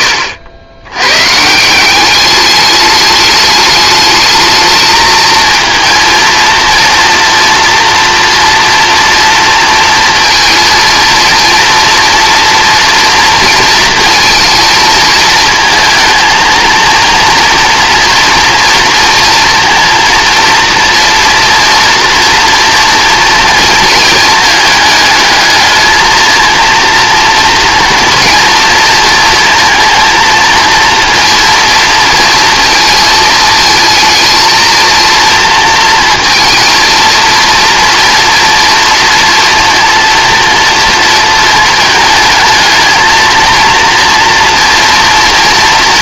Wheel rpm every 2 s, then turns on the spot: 100, 210, 220, 230, 230, 230, 230, 220, 230, 240, 230, 230, 220, 230, 230, 230, 230, 230, 230, 230, 230, 220, 230.
none